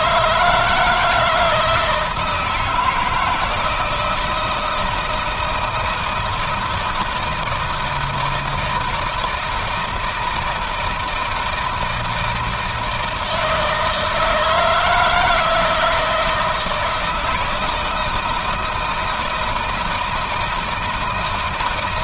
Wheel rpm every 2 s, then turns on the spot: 160, 160, 170, 160, 160, 160, 160, 160, 160, 160, 160.
none